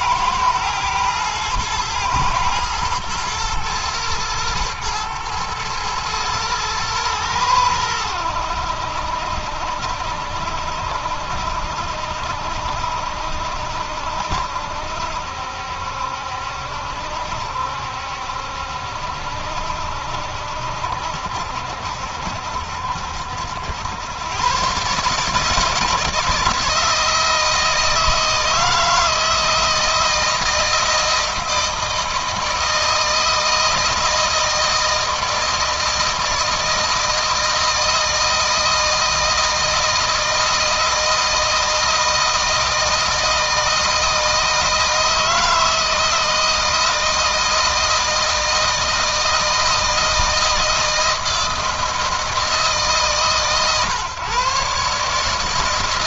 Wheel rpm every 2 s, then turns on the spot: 120, 110, 110, 110, 70, 70, 70, 70, 70, 70, 70, 70, 140, 160, 160, 160, 160, 160, 160, 160, 160, 160, 160, 160, 160, 160, 140, 140.
none